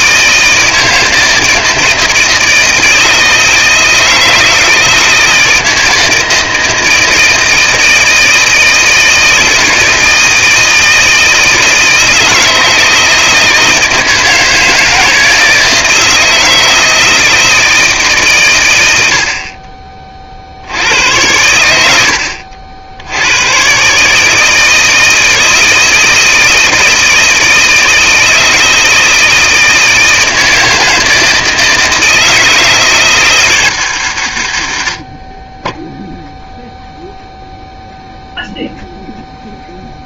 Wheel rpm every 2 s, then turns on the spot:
160, 160, 160, 160, 160, 160, 160, 160, 160, 120, 80, 80, 160, 160, 160, 160, 160, 90, 0, 0.
none